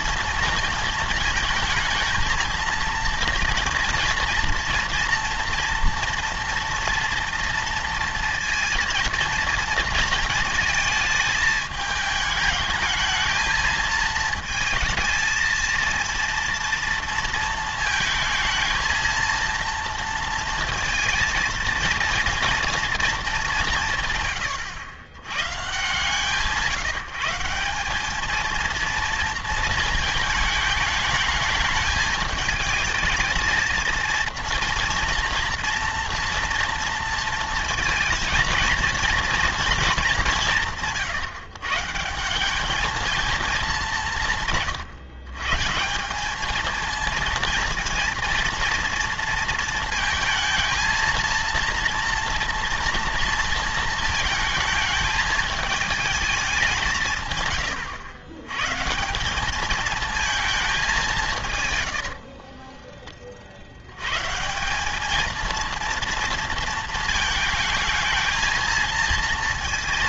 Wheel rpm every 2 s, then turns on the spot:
220, 230, 230, 230, 230, 220, 220, 220, 230, 230, 230, 220, 100, 160, 230, 220, 220, 230, 230, 230, 150, 220, 140, 230, 230, 230, 230, 220, 150, 170, 190, 20, 210, 220, 230.
none